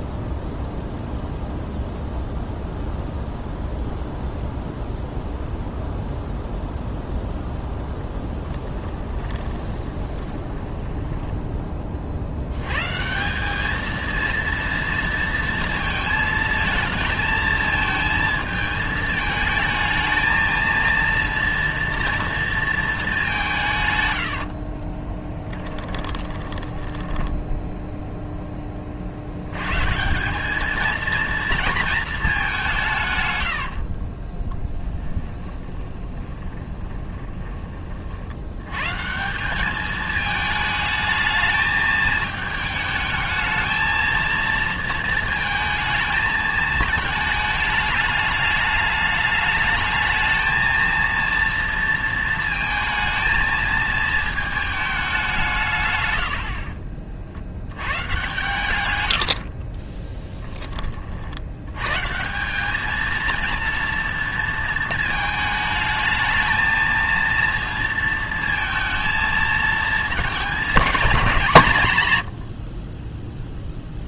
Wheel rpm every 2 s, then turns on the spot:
0, 0, 0, 0, 20, 10, 130, 230, 220, 220, 230, 220, 40, 20, 40, 220, 160, 20, 20, 120, 210, 220, 230, 220, 210, 230, 230, 210, 50, 120, 30, 210, 230, 230, 230, 210, 30.
8-12 24-28 34-38